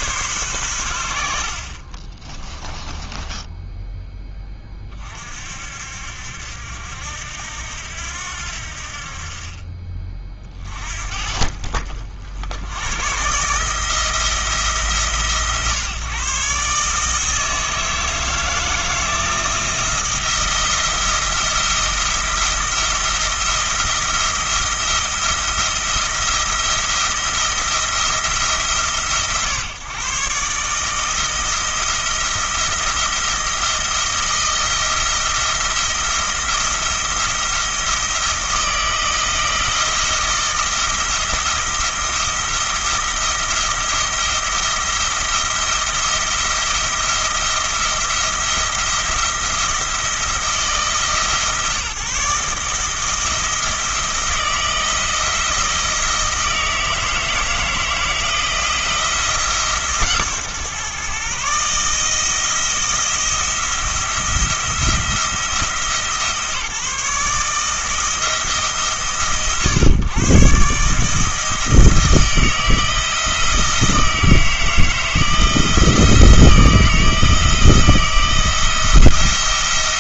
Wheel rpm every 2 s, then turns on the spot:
100, 20, 30, 70, 70, 40, 90, 150, 150, 160, 170, 170, 170, 170, 150, 150, 170, 170, 170, 170, 170, 170, 170, 170, 170, 160, 160, 170, 160, 170, 130, 170, 170, 150, 130, 150, 160, 160, 170, 170.
2-4